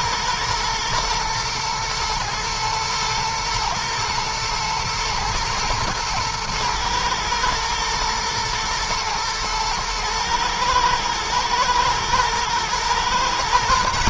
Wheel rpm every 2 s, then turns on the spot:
120, 120, 110, 110, 110, 110, 120.
none